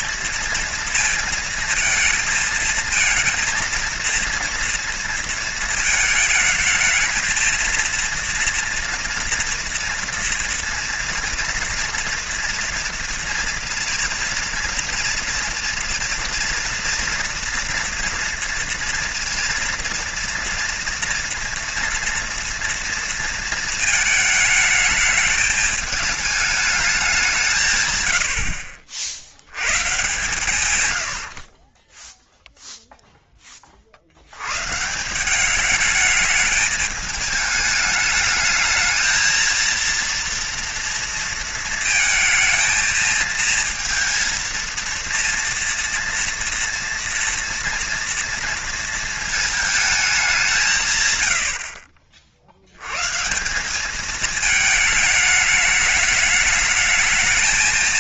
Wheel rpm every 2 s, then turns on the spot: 230, 230, 230, 220, 230, 230, 230, 230, 230, 230, 230, 230, 220, 200, 60, 100, 0, 130, 210, 220, 230, 230, 230, 230, 230, 140, 100, 220, 220.
none